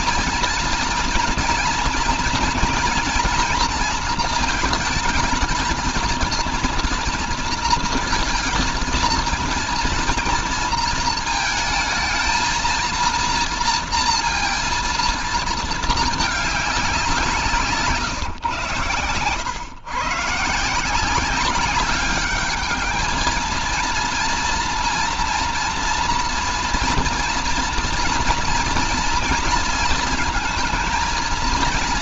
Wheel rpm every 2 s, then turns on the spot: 230, 240, 220, 230, 230, 230, 230, 230, 200, 120, 160, 210, 230, 230, 240, 230.
none